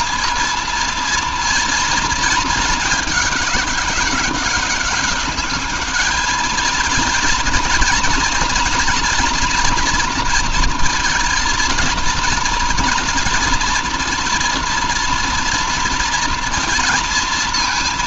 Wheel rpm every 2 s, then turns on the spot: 230, 210, 200, 220, 230, 230, 230, 240, 230.
none